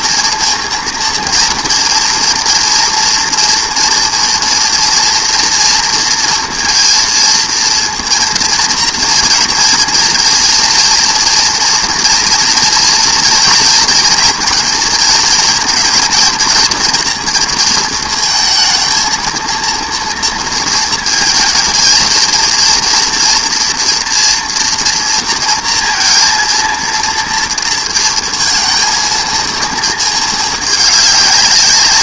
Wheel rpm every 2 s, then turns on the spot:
230, 230, 230, 230, 230, 230, 230, 230, 230, 220, 230, 230, 230, 230, 220, 210.
none